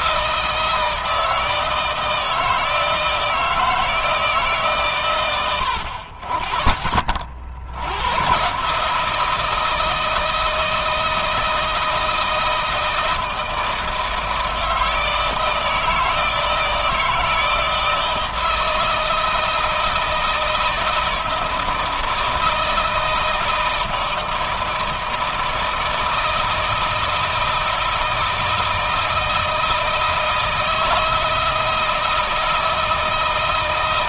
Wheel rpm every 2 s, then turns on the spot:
170, 160, 150, 40, 140, 160, 160, 160, 160, 160, 160, 160, 160, 160, 160, 160, 160.
none